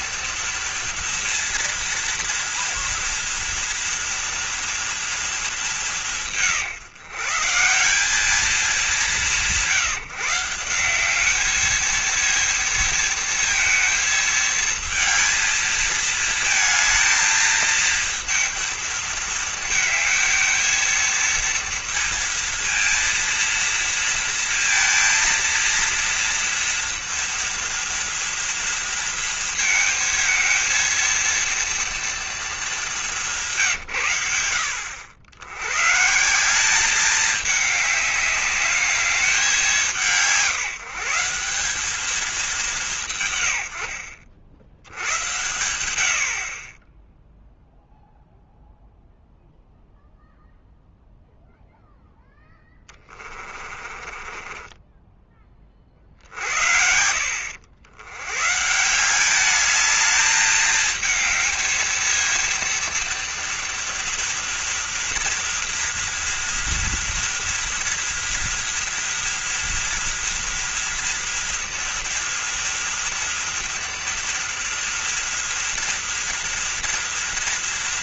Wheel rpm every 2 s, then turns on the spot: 230, 230, 230, 140, 190, 190, 220, 220, 220, 230, 220, 230, 230, 230, 230, 230, 210, 80, 200, 210, 180, 190, 80, 30, 0, 0, 20, 20, 60, 150, 220, 230, 230, 240, 230, 240, 230, 230, 230.
52-56